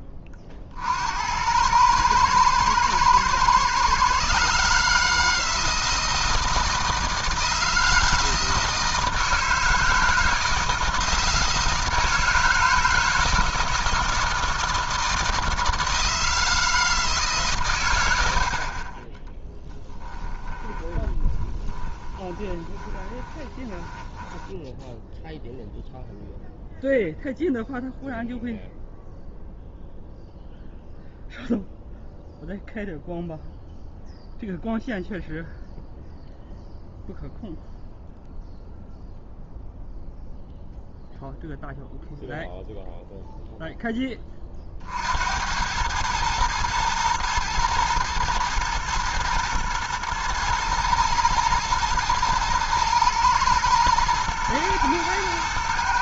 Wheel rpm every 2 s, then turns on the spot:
50, 110, 150, 160, 160, 160, 160, 160, 160, 60, 20, 20, 10, 0, 0, 0, 0, 0, 0, 0, 0, 0, 40, 110, 120, 110, 110, 110.
20-26